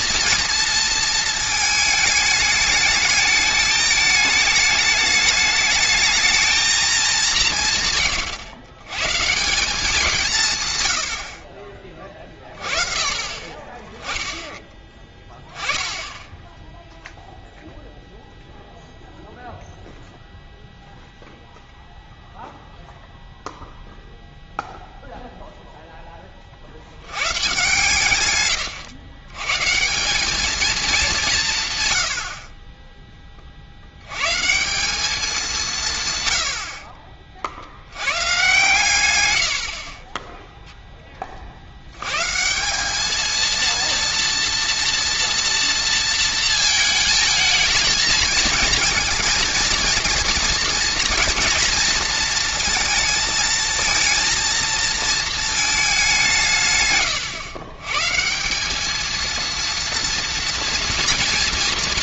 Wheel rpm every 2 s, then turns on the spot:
230, 210, 220, 220, 110, 150, 30, 10, 0, 0, 0, 0, 0, 50, 120, 220, 40, 170, 80, 130, 0, 170, 230, 230, 230, 230, 230, 230, 150, 190, 230.
none